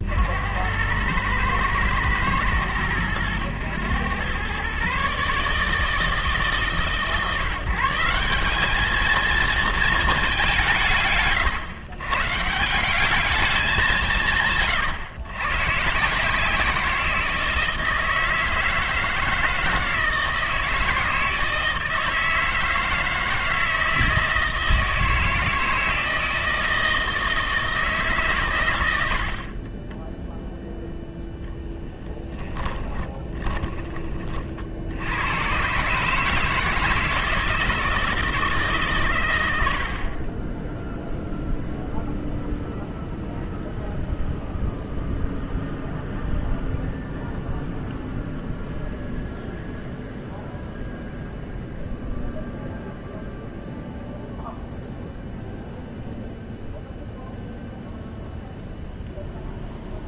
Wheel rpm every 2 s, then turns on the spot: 90, 110, 130, 140, 200, 150, 180, 120, 170, 160, 160, 160, 160, 160, 100, 0, 20, 60, 160, 150, 0, 0, 0, 0, 0, 0, 0, 0, 0, 0.
32-34